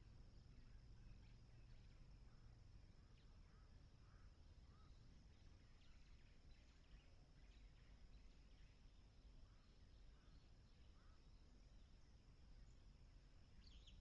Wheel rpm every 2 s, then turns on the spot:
0, 0, 0, 0, 0, 0, 0.
none